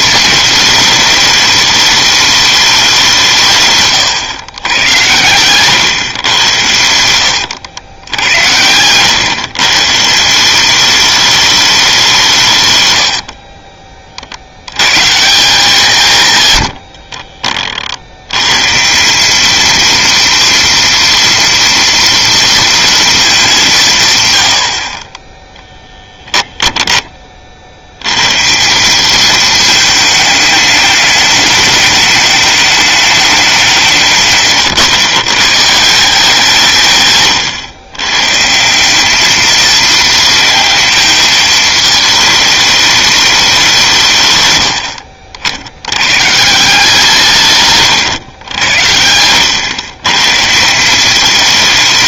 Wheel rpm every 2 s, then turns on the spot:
220, 190, 110, 90, 110, 200, 120, 110, 90, 150, 230, 230, 60, 10, 180, 210, 210, 140, 160, 180, 230, 210, 80, 150, 90, 170.
6-8 12-14 44-46